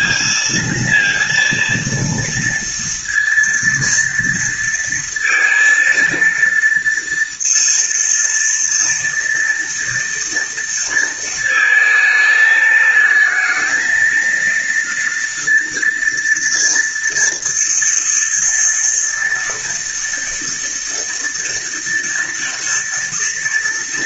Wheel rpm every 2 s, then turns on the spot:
230, 230, 230, 230, 230, 230, 220, 230, 230, 230, 230, 230.
none